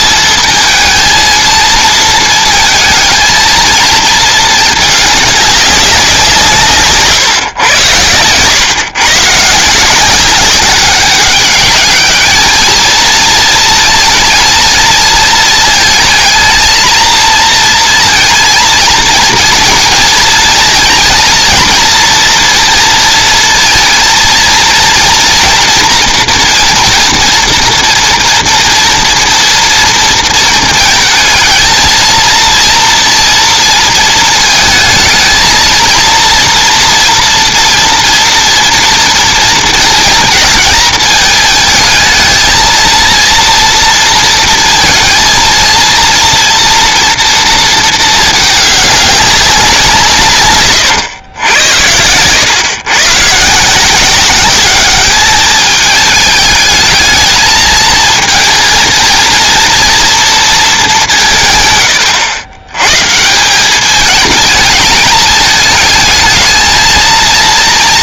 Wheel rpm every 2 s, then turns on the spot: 230, 230, 220, 150, 120, 200, 220, 220, 230, 230, 230, 230, 240, 230, 240, 230, 230, 230, 230, 230, 220, 230, 230, 230, 210, 130, 120, 200, 210, 220, 210, 110, 210, 220.
none